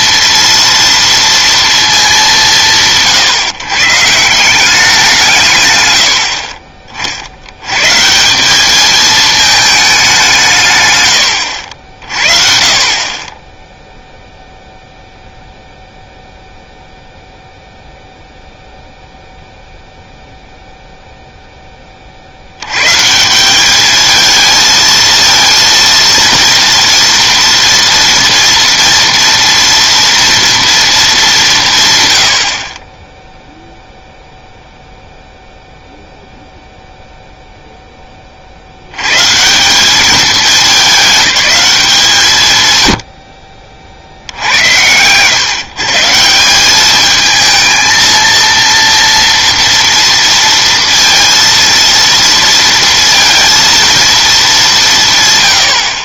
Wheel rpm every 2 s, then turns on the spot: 230, 170, 180, 50, 200, 140, 40, 0, 0, 0, 0, 110, 220, 230, 230, 230, 40, 0, 0, 80, 200, 120, 90, 190, 230, 230, 230, 190.
none